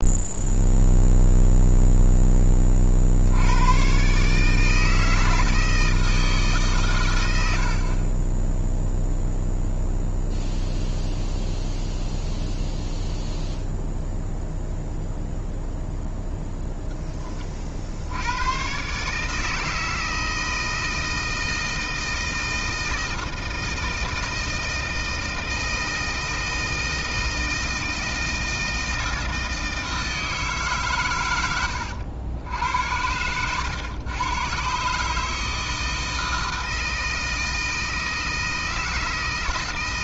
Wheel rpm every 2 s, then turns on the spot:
0, 50, 160, 120, 0, 0, 0, 0, 10, 140, 160, 160, 160, 160, 160, 120, 80, 150, 160, 160.
none